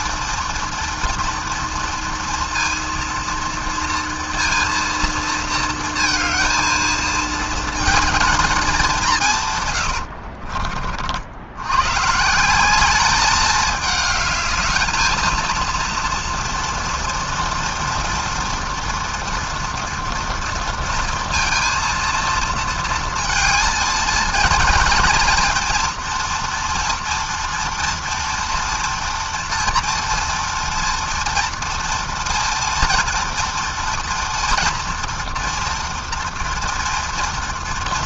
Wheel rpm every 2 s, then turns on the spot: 230, 230, 230, 230, 160, 70, 200, 220, 230, 230, 230, 230, 230, 240, 230, 230, 240, 240, 230.
none